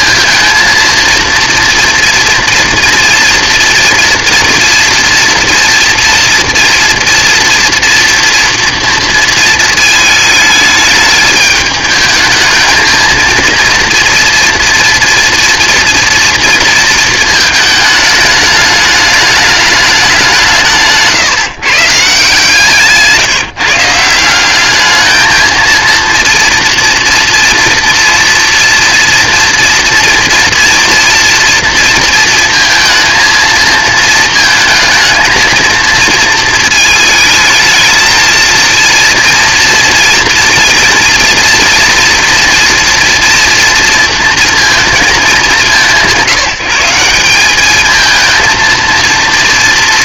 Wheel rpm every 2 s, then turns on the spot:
230, 230, 230, 230, 230, 220, 220, 230, 230, 210, 180, 160, 190, 230, 230, 240, 230, 220, 220, 230, 230, 230, 230, 180, 220.
none